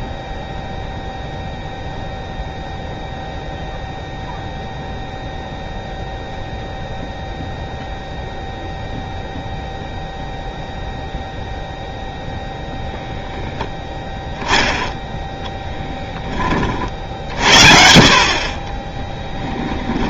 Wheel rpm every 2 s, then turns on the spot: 0, 0, 0, 0, 0, 0, 0, 0, 40, 40.
18-20